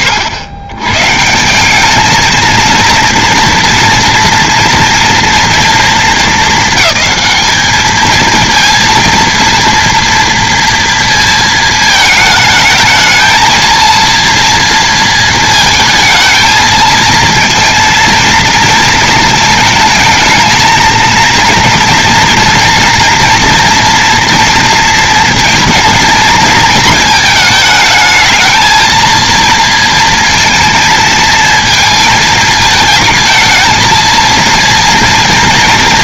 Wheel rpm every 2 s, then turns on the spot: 110, 230, 230, 200, 230, 230, 220, 230, 220, 230, 220, 230, 230, 220, 230, 230, 230, 230.
none